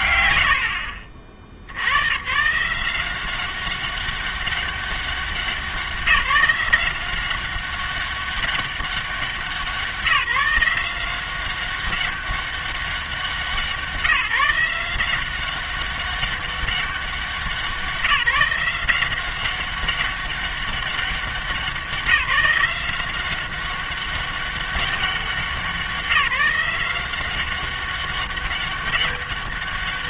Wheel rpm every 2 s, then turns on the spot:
100, 160, 200, 180, 200, 180, 190, 170, 200, 180, 200, 180, 200, 180, 200.
none